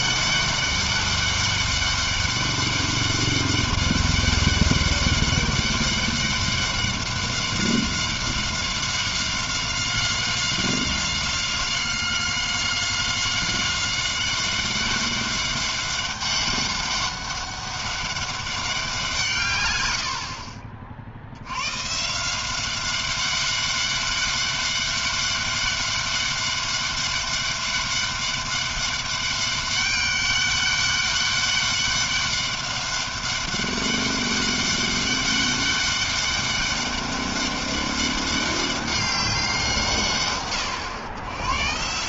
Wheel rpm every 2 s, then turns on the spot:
200, 200, 200, 200, 190, 190, 190, 190, 200, 200, 50, 180, 200, 200, 200, 200, 200, 200, 200, 200, 120.
none